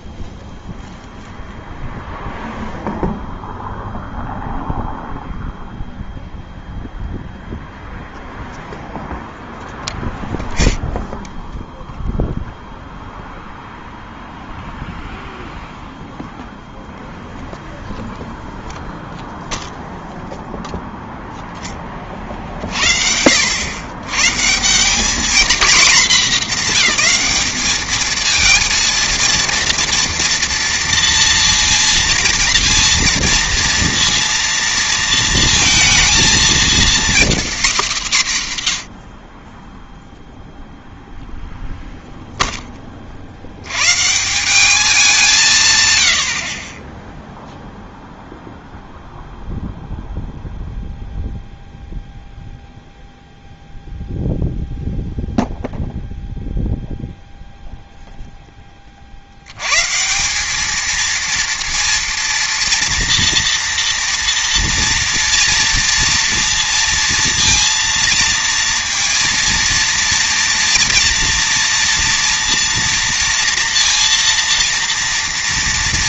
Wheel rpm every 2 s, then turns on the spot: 0, 0, 0, 0, 0, 10, 0, 0, 0, 0, 0, 50, 170, 220, 230, 230, 230, 230, 240, 140, 0, 20, 200, 30, 0, 0, 0, 0, 0, 20, 210, 240, 230, 230, 230, 230, 240, 230.
none